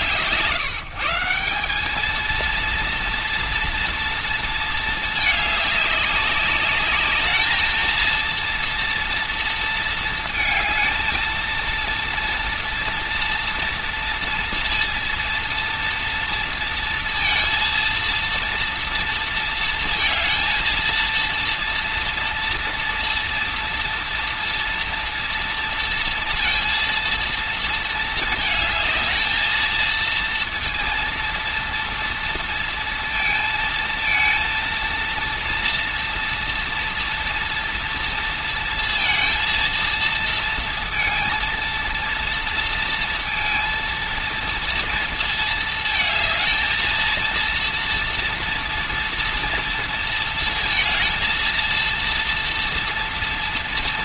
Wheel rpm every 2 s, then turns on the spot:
160, 230, 230, 200, 230, 220, 230, 230, 230, 230, 230, 230, 230, 230, 220, 230, 230, 230, 240, 230, 230, 230, 230, 220, 230, 230, 230.
none